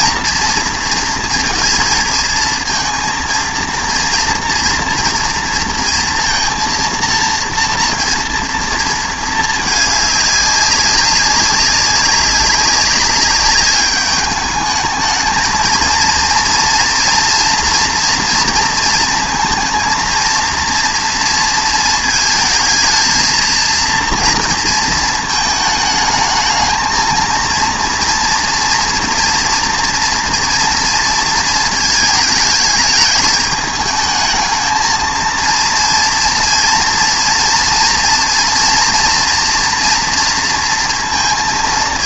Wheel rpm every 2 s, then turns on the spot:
230, 230, 230, 230, 230, 200, 190, 210, 240, 230, 230, 220, 230, 220, 230, 230, 210, 220, 230, 230, 230.
none